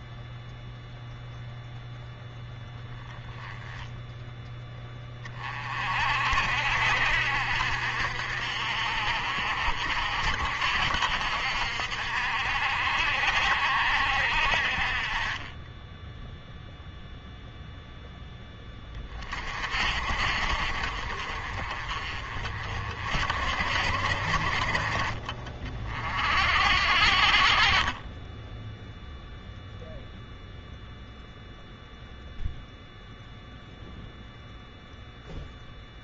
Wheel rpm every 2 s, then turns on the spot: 0, 10, 10, 60, 60, 60, 60, 40, 0, 20, 50, 50, 50, 70, 0, 0, 0, 0.
none